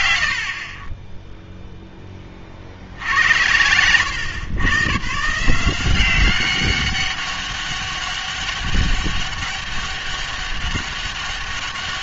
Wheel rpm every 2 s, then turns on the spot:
70, 60, 110, 190, 200, 200.
none